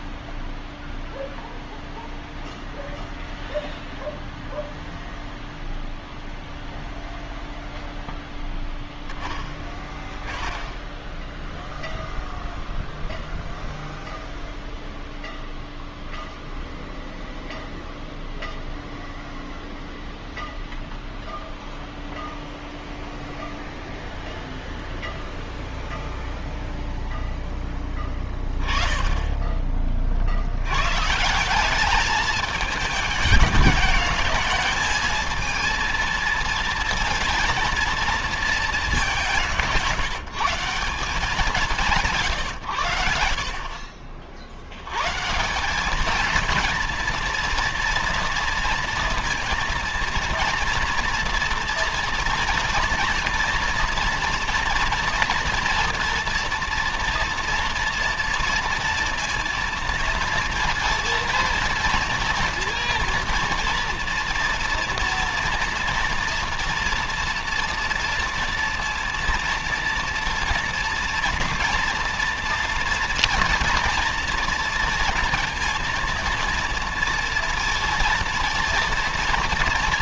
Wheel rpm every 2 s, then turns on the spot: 0, 0, 0, 0, 0, 10, 0, 0, 0, 0, 0, 0, 0, 0, 20, 110, 210, 210, 230, 210, 170, 110, 80, 230, 230, 230, 230, 240, 230, 230, 230, 230, 230, 230, 230, 240, 240, 230, 230, 230.
none